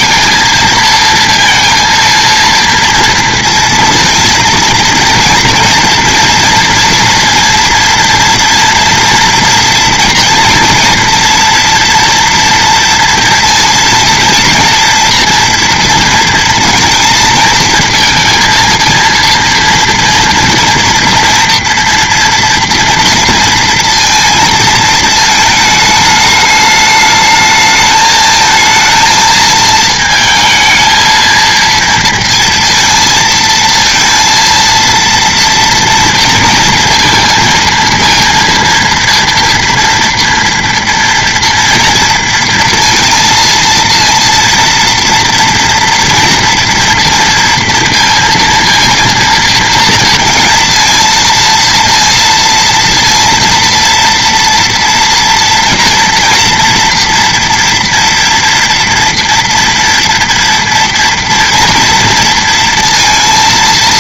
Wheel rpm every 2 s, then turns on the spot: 230, 230, 230, 230, 240, 230, 230, 230, 230, 230, 240, 230, 230, 210, 220, 220, 230, 230, 230, 230, 230, 230, 230, 230, 230, 230, 230, 240, 240, 230, 230, 230.
none